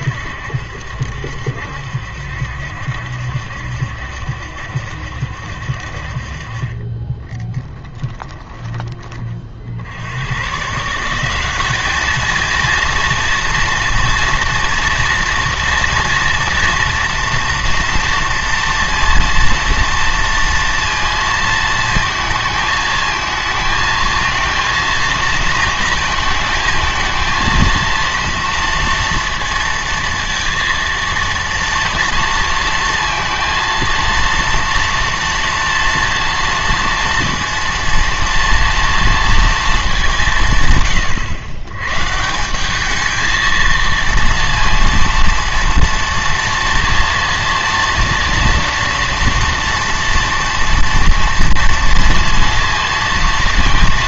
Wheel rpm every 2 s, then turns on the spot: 70, 70, 70, 30, 20, 150, 230, 230, 230, 230, 230, 220, 230, 220, 230, 230, 230, 230, 230, 230, 140, 190, 230, 230, 230, 230, 230.
none